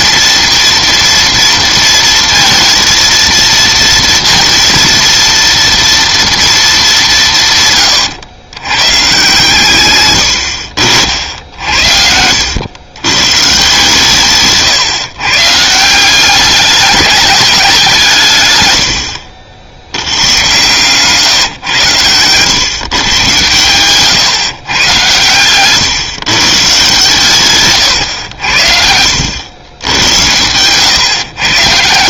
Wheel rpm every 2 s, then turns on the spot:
230, 230, 230, 220, 110, 60, 100, 150, 200, 110, 130, 120, 140, 140, 70, 120.
14-16 28-30